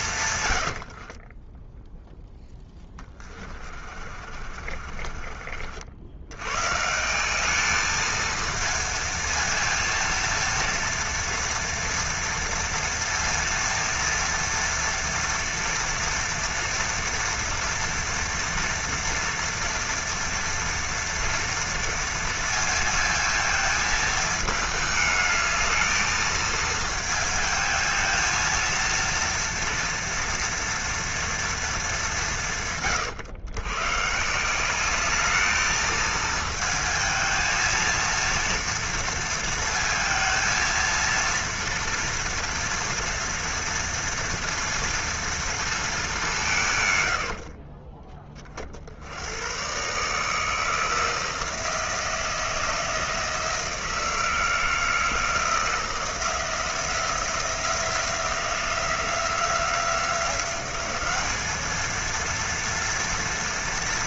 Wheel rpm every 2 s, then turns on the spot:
80, 10, 40, 140, 230, 230, 230, 230, 230, 230, 230, 230, 220, 220, 230, 240, 150, 190, 230, 230, 220, 230, 230, 160, 50, 160, 170, 170, 170, 180, 190, 230.
0-6